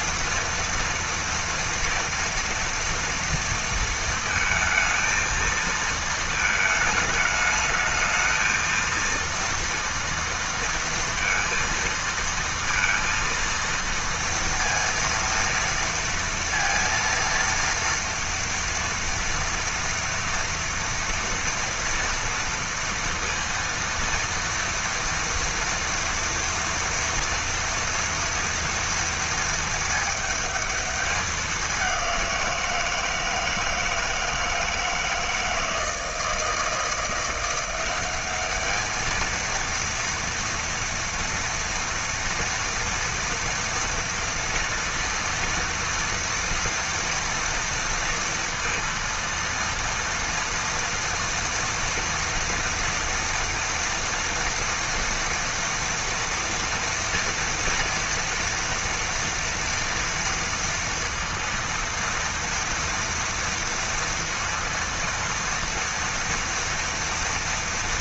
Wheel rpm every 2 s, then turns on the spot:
240, 230, 220, 220, 220, 230, 230, 230, 230, 230, 230, 230, 230, 240, 230, 220, 180, 160, 160, 200, 230, 230, 230, 230, 230, 230, 230, 240, 230, 230, 230, 230, 230, 230.
none